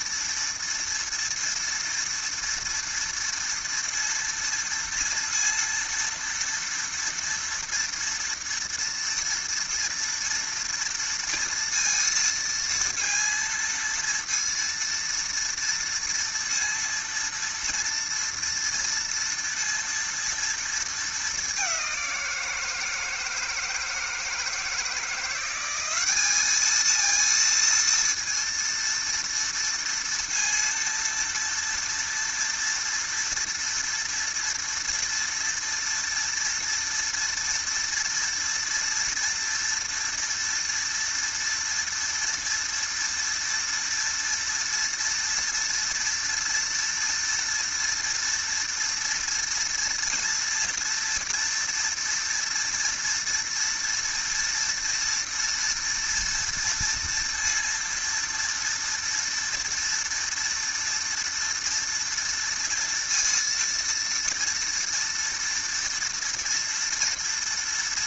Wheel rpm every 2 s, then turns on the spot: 230, 230, 230, 230, 230, 230, 230, 230, 230, 230, 220, 160, 170, 220, 230, 230, 240, 230, 240, 230, 230, 230, 240, 230, 230, 230, 230, 230, 230, 230, 230, 230, 230, 230.
none